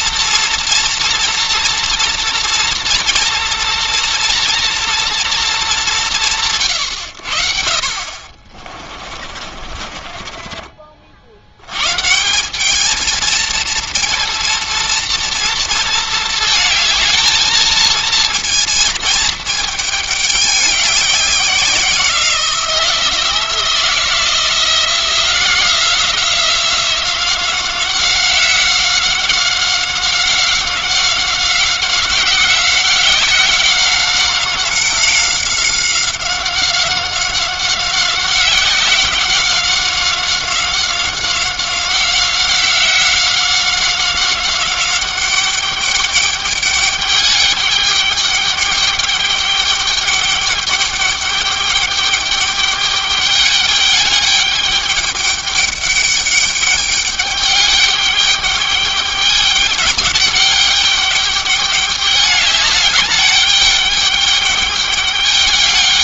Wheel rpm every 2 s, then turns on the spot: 230, 230, 230, 110, 30, 30, 210, 230, 220, 230, 200, 170, 170, 180, 190, 190, 190, 190, 190, 190, 190, 190, 190, 200, 200, 210, 200, 210, 200, 210, 200, 200, 200.
8-10